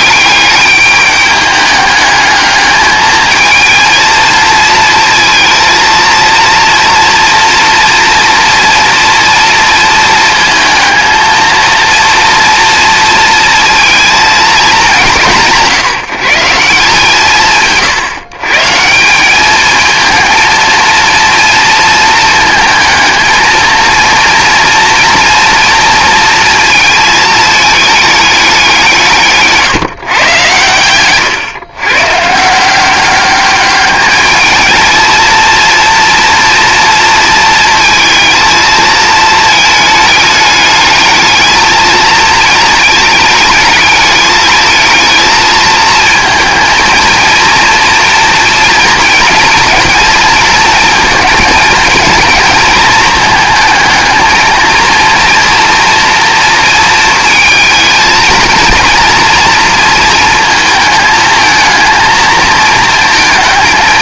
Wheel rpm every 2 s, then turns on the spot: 200, 220, 230, 240, 240, 220, 230, 200, 160, 160, 230, 220, 230, 230, 180, 110, 170, 220, 230, 220, 210, 220, 220, 230, 240, 220, 220, 220, 230, 230, 220, 220.
none